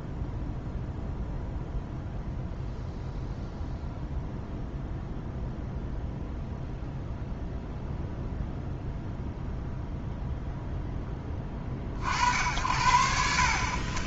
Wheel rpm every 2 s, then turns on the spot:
0, 0, 0, 0, 0, 0, 70.
none